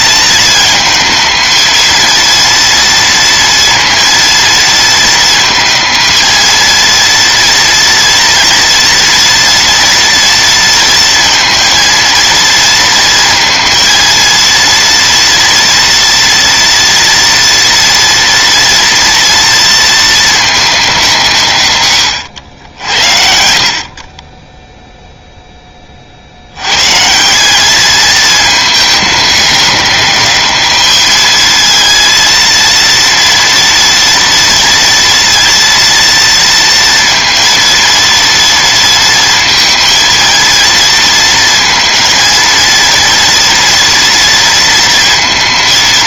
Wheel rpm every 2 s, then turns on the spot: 220, 230, 230, 230, 240, 230, 230, 230, 230, 230, 180, 70, 0, 130, 210, 210, 230, 230, 230, 230, 230, 230, 230.
none